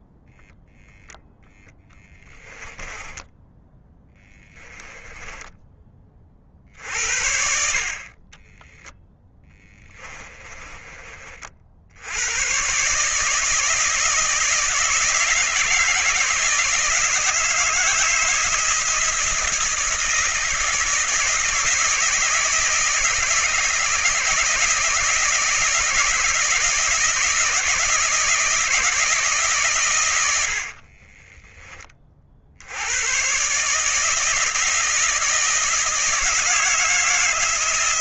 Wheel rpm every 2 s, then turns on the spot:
0, 10, 10, 60, 10, 20, 140, 160, 160, 160, 160, 170, 160, 160, 160, 50, 90, 160, 160.
2-6 10-12 30-32